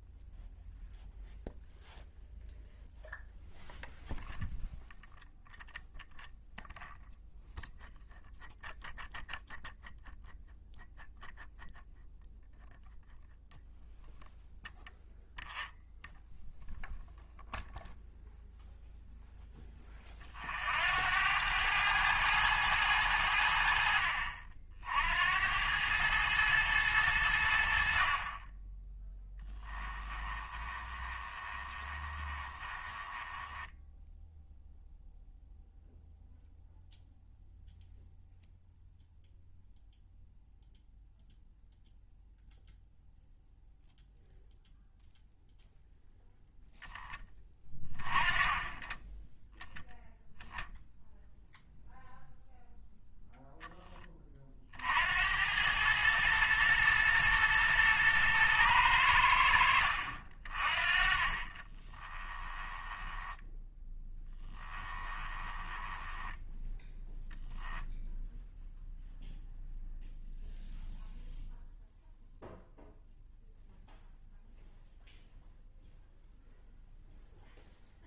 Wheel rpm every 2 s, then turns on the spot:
0, 0, 0, 0, 0, 0, 0, 0, 0, 0, 70, 100, 60, 100, 10, 20, 20, 0, 0, 0, 0, 0, 0, 0, 10, 0, 0, 60, 110, 110, 40, 10, 20, 10, 0, 0, 0, 0, 0.
30-34 60-66